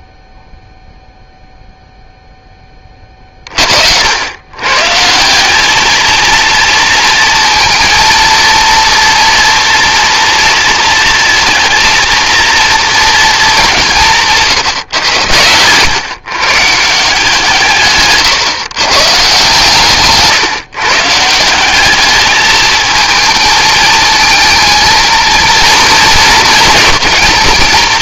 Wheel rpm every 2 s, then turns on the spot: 0, 20, 120, 230, 230, 230, 220, 140, 150, 130, 150, 220, 230, 220.
none